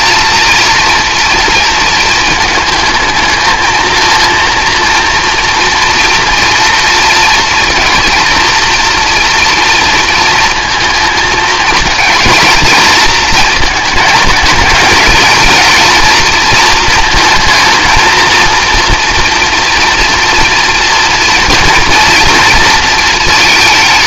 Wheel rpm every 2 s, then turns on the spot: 240, 220, 230, 230, 230, 230, 230, 220, 230, 230, 230, 230.
none